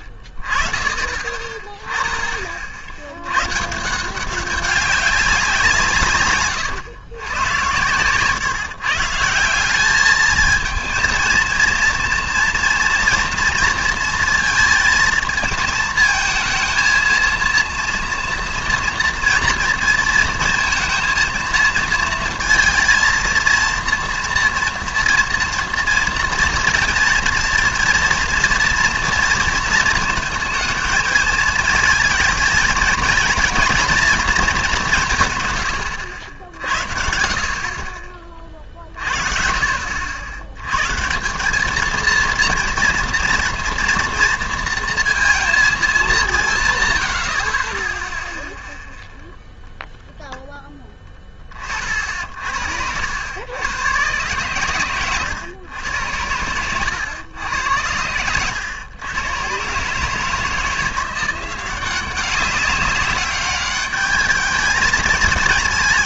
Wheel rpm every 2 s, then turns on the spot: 30, 50, 200, 120, 140, 220, 240, 230, 220, 230, 230, 230, 230, 230, 230, 220, 220, 200, 70, 40, 110, 230, 230, 140, 0, 10, 70, 120, 100, 110, 170, 200, 220.
none